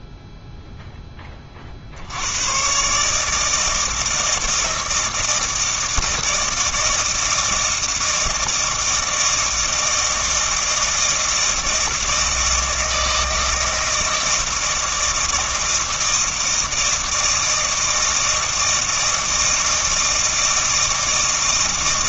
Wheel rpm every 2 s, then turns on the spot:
0, 130, 160, 160, 160, 160, 160, 160, 160, 160, 160.
none